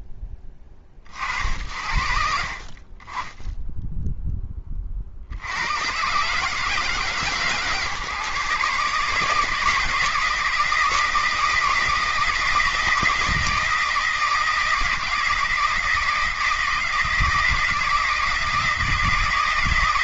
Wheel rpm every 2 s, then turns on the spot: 30, 30, 30, 150, 140, 160, 160, 160, 170, 160.
none